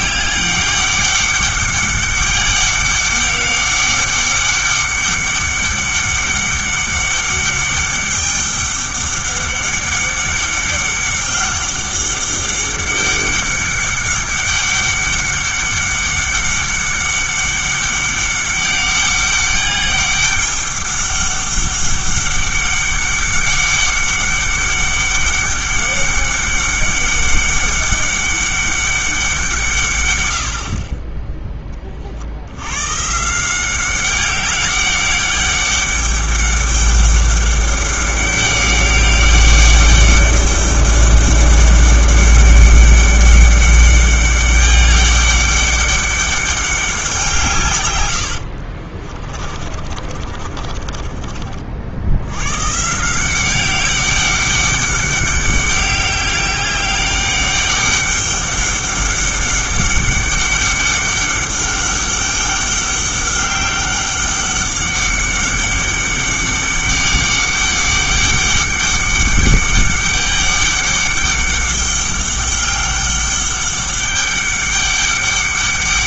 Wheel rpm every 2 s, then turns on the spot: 200, 200, 200, 200, 200, 200, 200, 200, 200, 200, 200, 200, 200, 200, 200, 50, 110, 200, 200, 200, 200, 200, 200, 190, 40, 40, 130, 200, 200, 200, 200, 200, 200, 200, 200, 200, 200, 200.
48-52